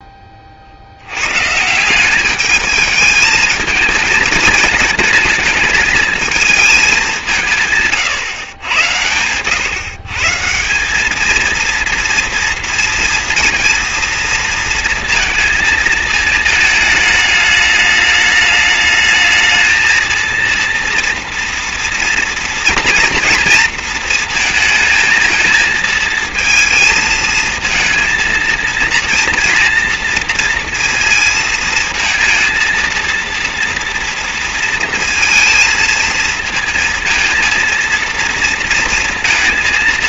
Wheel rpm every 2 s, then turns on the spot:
100, 220, 220, 190, 110, 210, 230, 230, 210, 220, 230, 230, 220, 220, 230, 230, 230, 230, 230, 230.
none